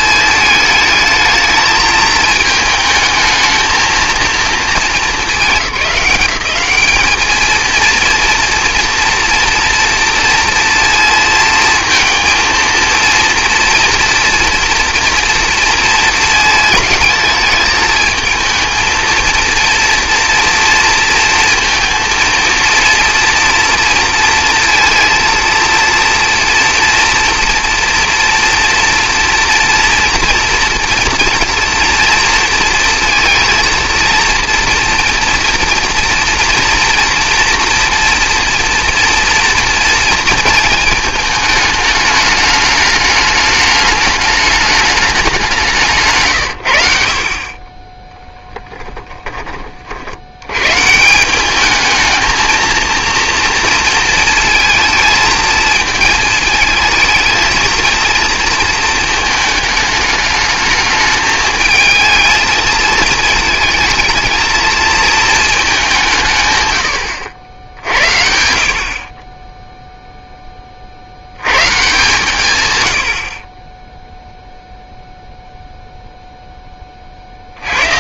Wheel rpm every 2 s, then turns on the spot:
220, 220, 230, 190, 230, 230, 230, 230, 220, 220, 230, 230, 230, 230, 240, 230, 230, 230, 240, 230, 220, 210, 210, 100, 10, 120, 230, 220, 220, 220, 220, 220, 220, 130, 60, 30, 130, 0, 10.
48-50